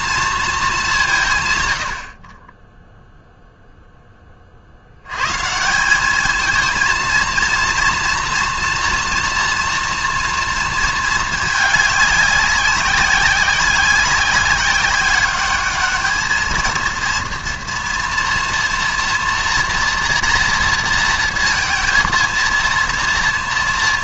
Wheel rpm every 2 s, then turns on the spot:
200, 10, 60, 230, 230, 220, 190, 190, 220, 230, 230, 230.
none